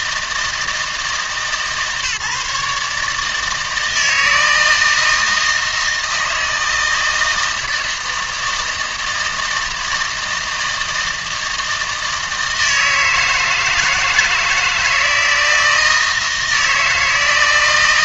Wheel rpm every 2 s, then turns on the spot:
160, 150, 160, 160, 160, 160, 160, 160, 160.
none